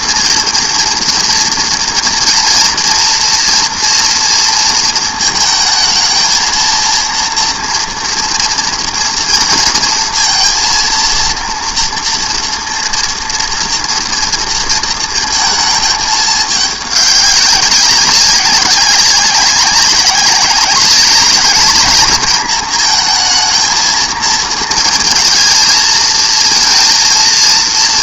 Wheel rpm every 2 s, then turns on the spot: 230, 230, 230, 230, 230, 230, 230, 230, 200, 190, 190, 230, 220, 220.
none